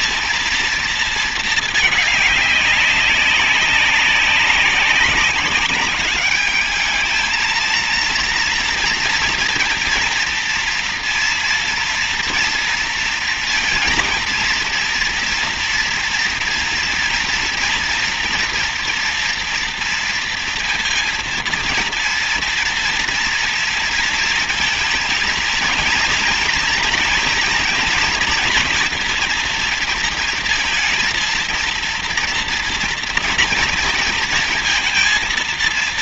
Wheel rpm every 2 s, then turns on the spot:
230, 200, 200, 210, 230, 230, 230, 230, 240, 240, 230, 230, 230, 240, 240, 230, 240, 230.
none